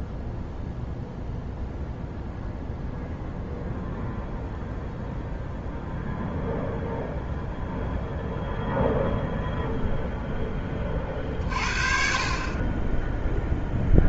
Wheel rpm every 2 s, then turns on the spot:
0, 0, 0, 0, 0, 20, 20.
none